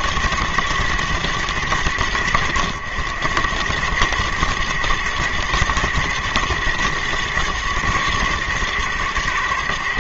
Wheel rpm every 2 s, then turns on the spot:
110, 100, 110, 120, 120.
none